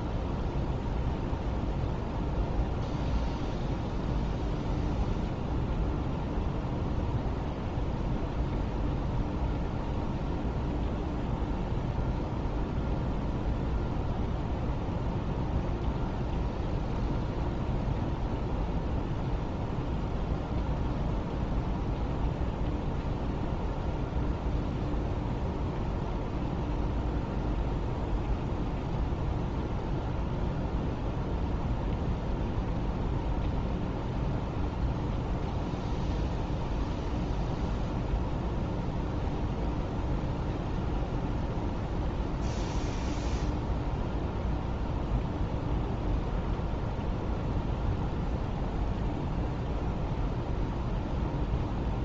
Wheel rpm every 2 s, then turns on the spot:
0, 0, 0, 0, 0, 0, 0, 0, 0, 0, 0, 0, 0, 0, 0, 0, 0, 0, 0, 0, 0, 0, 0, 0, 0, 0.
none